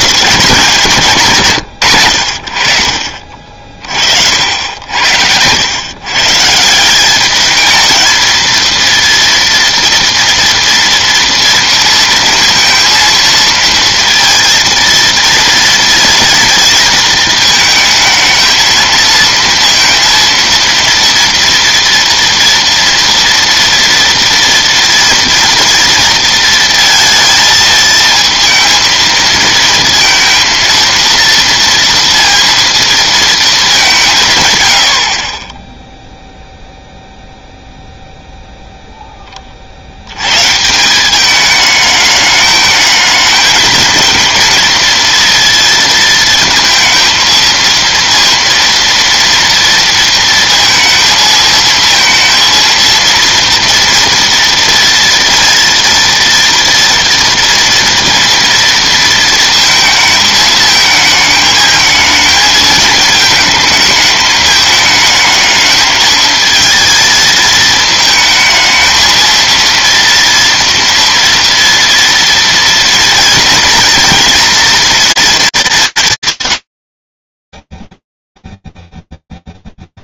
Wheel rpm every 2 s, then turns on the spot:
190, 70, 80, 160, 230, 230, 230, 230, 230, 230, 230, 230, 230, 230, 220, 230, 230, 110, 0, 0, 150, 220, 230, 230, 230, 230, 230, 230, 230, 230, 220, 220, 220, 220, 220, 230, 230, 230, 140, 0.
none